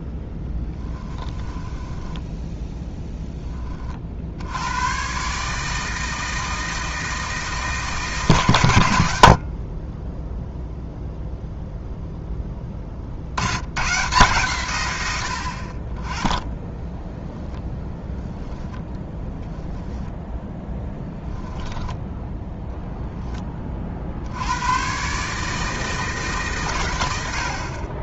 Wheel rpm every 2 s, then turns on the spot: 10, 0, 100, 160, 110, 0, 40, 110, 0, 10, 0, 0, 120, 130.
0-2 18-20